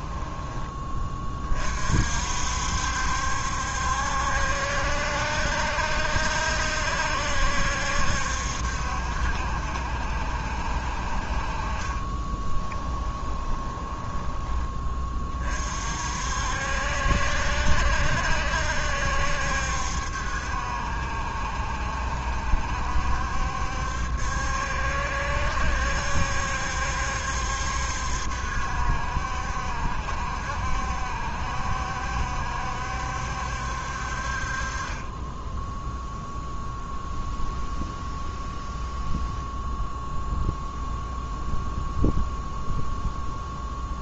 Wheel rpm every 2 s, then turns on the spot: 20, 70, 70, 70, 70, 60, 20, 30, 60, 70, 70, 70, 70, 70, 70, 70, 70, 30, 0, 0, 0, 0.
12-14